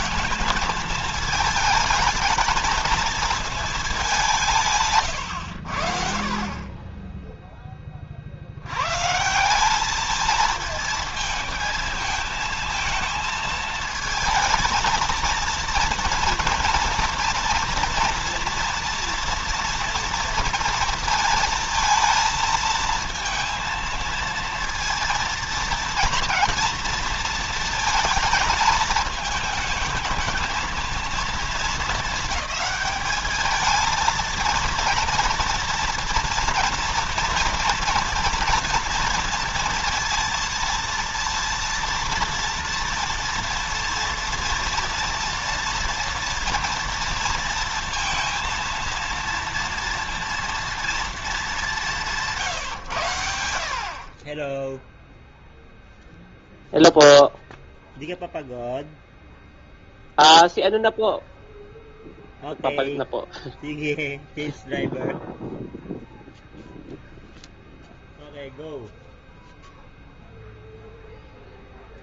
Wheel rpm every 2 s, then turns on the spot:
230, 230, 150, 30, 110, 230, 220, 230, 240, 230, 230, 220, 230, 230, 220, 230, 210, 230, 240, 230, 230, 240, 230, 230, 230, 230, 110, 0, 0, 0, 0, 0, 0, 0, 0, 0.
none